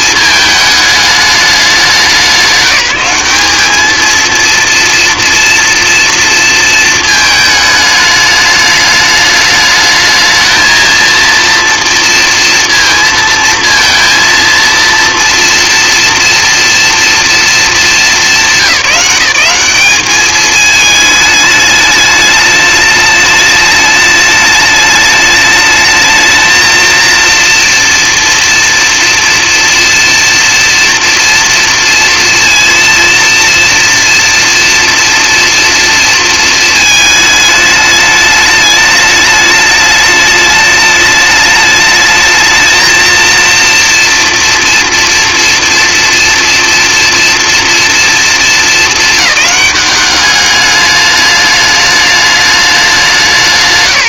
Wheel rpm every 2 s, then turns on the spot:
220, 190, 230, 230, 210, 220, 230, 240, 230, 180, 210, 210, 210, 230, 240, 230, 230, 230, 220, 210, 210, 230, 230, 240, 220, 210, 200.
none